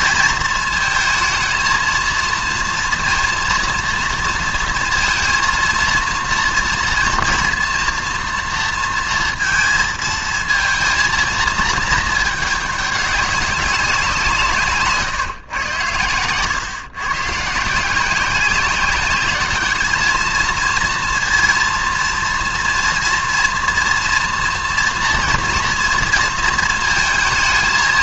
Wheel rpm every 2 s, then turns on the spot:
220, 230, 230, 230, 230, 230, 200, 140, 130, 190, 230, 230, 230, 230.
14-16